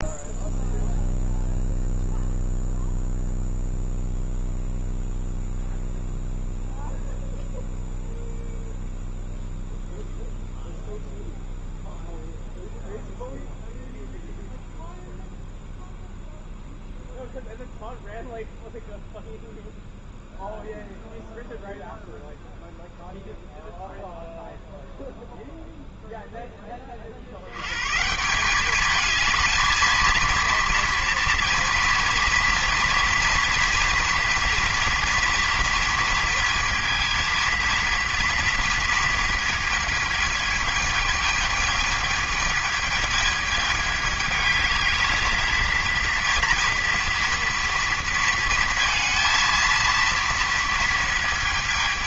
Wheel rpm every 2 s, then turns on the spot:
0, 0, 0, 0, 0, 0, 0, 0, 0, 0, 0, 0, 0, 20, 200, 230, 230, 230, 230, 230, 220, 220, 220, 230, 220, 230.
none